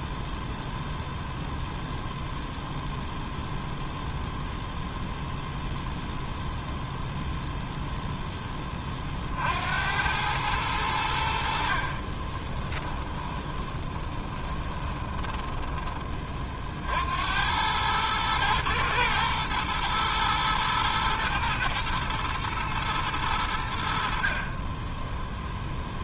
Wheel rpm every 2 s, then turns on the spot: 0, 0, 0, 0, 30, 90, 20, 20, 60, 110, 120, 110, 10.
12-16 24-26